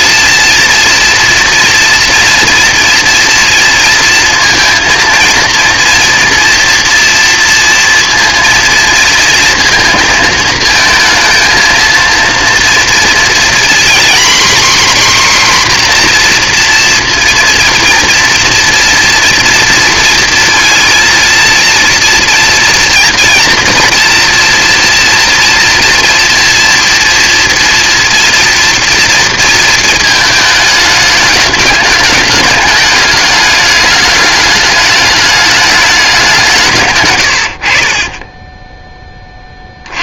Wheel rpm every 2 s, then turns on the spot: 230, 230, 230, 240, 230, 220, 230, 260, 240, 230, 230, 230, 230, 230, 230, 220, 210, 210, 170, 20.
38-40